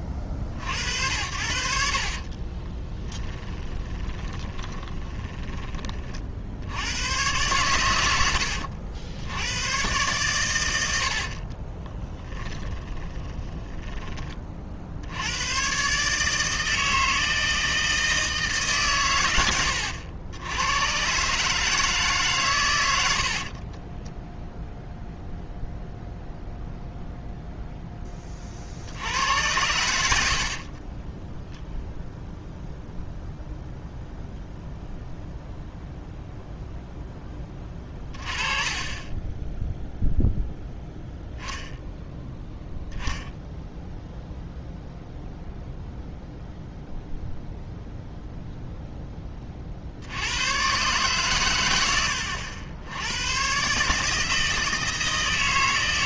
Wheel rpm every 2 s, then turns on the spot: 40, 30, 20, 70, 80, 100, 20, 40, 150, 150, 100, 120, 0, 0, 40, 40, 0, 0, 0, 30, 0, 0, 0, 0, 0, 110, 90, 160.
2-6 12-14 30-32 38-40